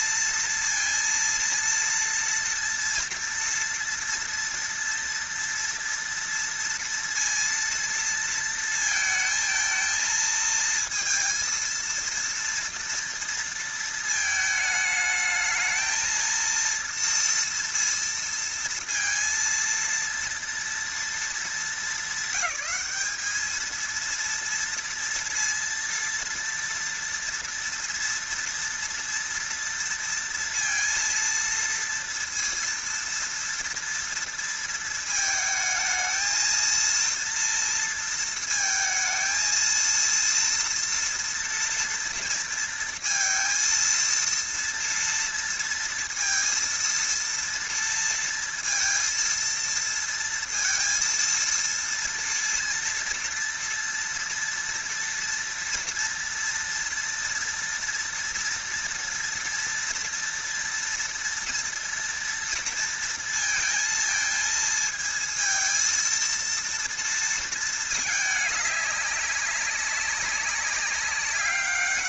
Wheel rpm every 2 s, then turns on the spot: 230, 230, 230, 230, 230, 230, 230, 220, 230, 230, 230, 220, 230, 230, 230, 230, 230, 220, 230, 230, 230, 230, 230, 230, 230, 230, 230, 230, 230, 230, 230, 230, 230, 230, 200, 200.
none